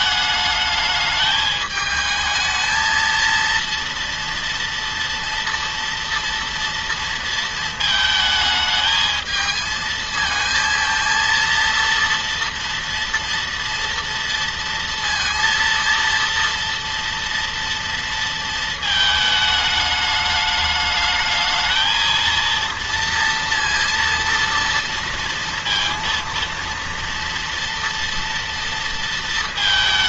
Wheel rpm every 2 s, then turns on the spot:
210, 220, 230, 230, 220, 230, 230, 230, 230, 220, 210, 230, 230, 230, 230.
none